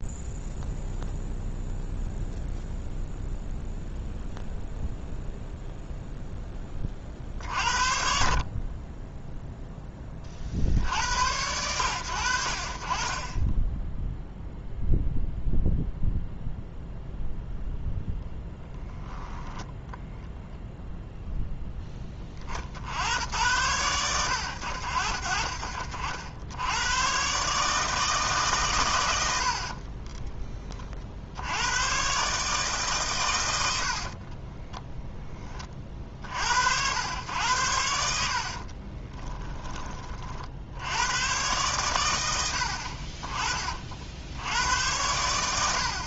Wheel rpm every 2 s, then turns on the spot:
0, 0, 0, 30, 20, 60, 50, 0, 0, 10, 0, 60, 70, 90, 120, 30, 140, 10, 80, 30, 80, 60, 80.
18-20 34-36 38-40